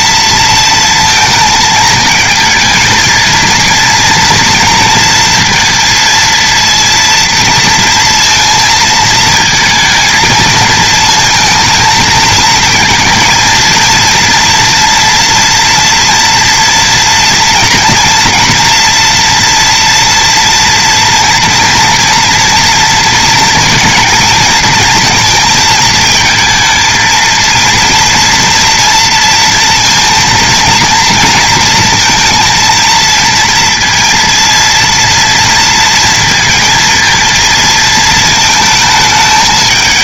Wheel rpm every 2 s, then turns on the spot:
230, 220, 230, 230, 230, 220, 230, 230, 230, 230, 230, 230, 230, 220, 230, 230, 230, 230, 230, 220.
none